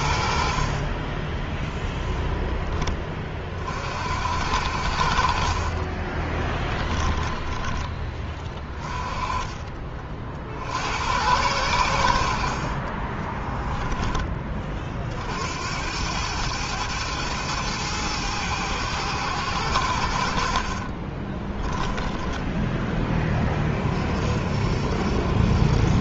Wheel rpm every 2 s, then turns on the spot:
50, 10, 60, 20, 20, 60, 50, 30, 110, 110, 70, 10, 50.
12-14 20-22